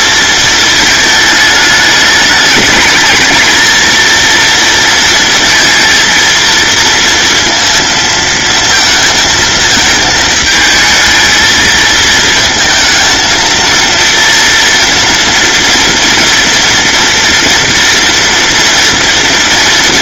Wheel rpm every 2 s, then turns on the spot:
220, 220, 230, 230, 230, 220, 230, 230, 230, 230.
none